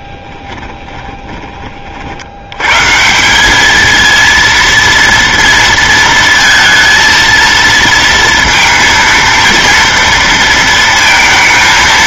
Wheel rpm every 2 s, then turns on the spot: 20, 110, 230, 230, 230, 230.
0-2